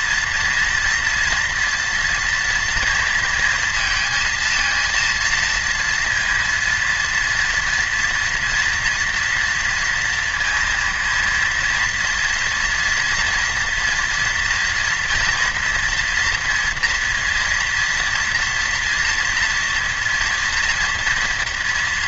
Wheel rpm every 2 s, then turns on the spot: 230, 230, 230, 230, 230, 230, 230, 240, 230, 230, 230.
none